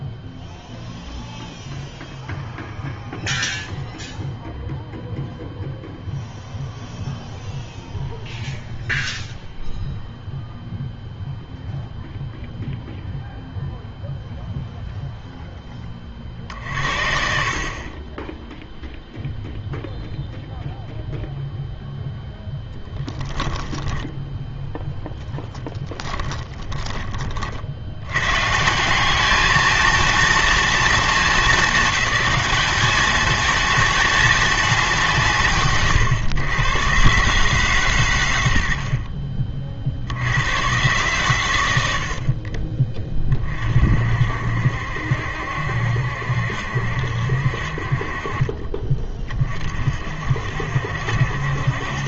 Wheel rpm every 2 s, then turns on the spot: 0, 0, 0, 0, 0, 0, 0, 0, 60, 0, 0, 0, 0, 20, 150, 230, 210, 200, 120, 70, 110, 30, 60, 70, 40, 70.
26-28